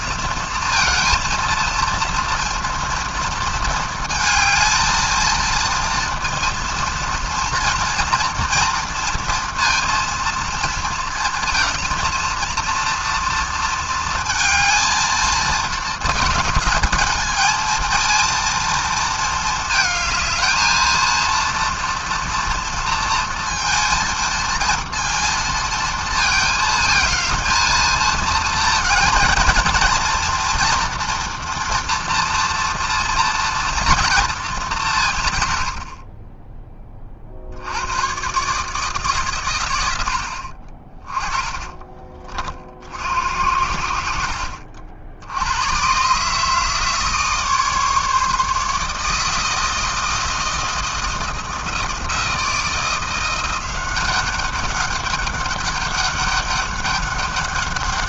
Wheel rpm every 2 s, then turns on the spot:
230, 230, 220, 230, 230, 230, 230, 220, 220, 230, 220, 230, 230, 220, 230, 240, 230, 190, 20, 150, 50, 60, 70, 150, 150, 170, 170, 200, 200.
none